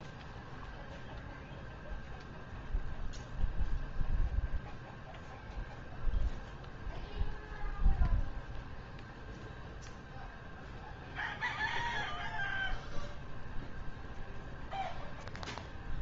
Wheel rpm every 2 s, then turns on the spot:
0, 0, 0, 0, 0, 0, 0, 0.
none